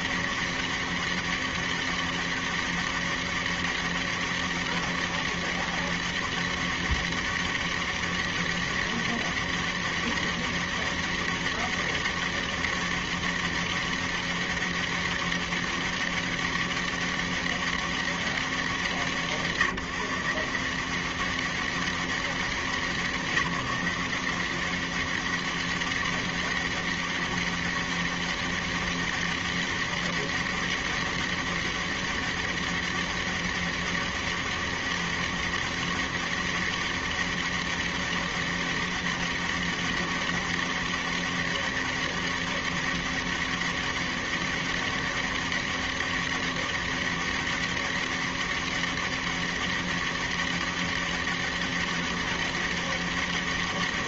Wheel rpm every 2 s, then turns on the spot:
200, 200, 200, 200, 200, 200, 200, 200, 200, 170, 190, 180, 190, 200, 200, 200, 200, 200, 200, 200, 200, 200, 200, 200, 200, 200, 200.
none